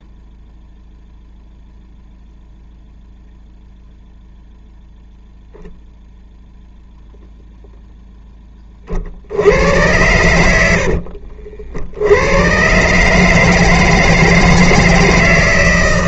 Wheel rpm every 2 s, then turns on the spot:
0, 0, 0, 0, 10, 90, 100, 160.
10-12